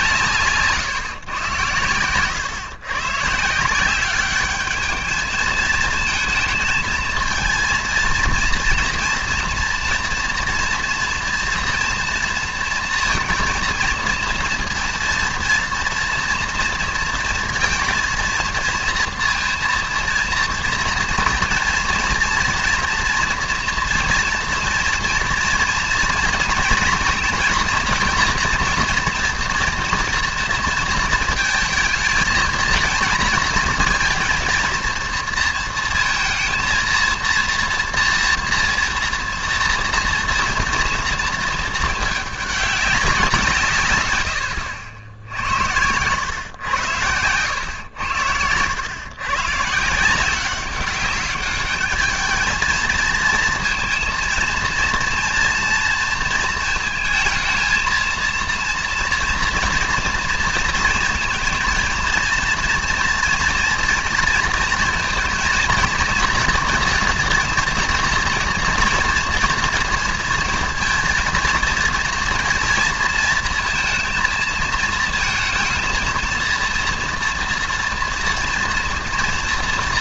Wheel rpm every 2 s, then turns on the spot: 150, 110, 210, 220, 230, 230, 230, 230, 230, 230, 230, 230, 240, 230, 230, 240, 230, 230, 230, 230, 230, 200, 90, 100, 100, 190, 220, 230, 230, 230, 230, 240, 230, 230, 230, 230, 230, 230, 230, 240.
none